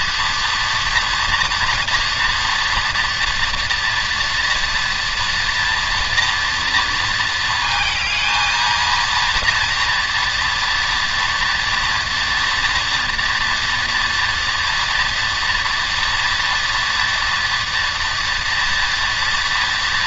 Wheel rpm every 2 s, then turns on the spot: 230, 230, 240, 230, 230, 230, 230, 240, 230, 230.
none